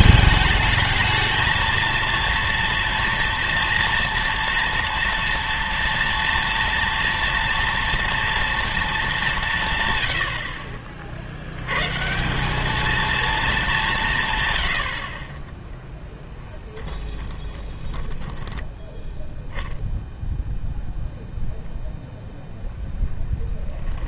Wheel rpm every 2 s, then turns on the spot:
220, 230, 230, 230, 230, 50, 210, 90, 10, 10, 0, 0.
16-18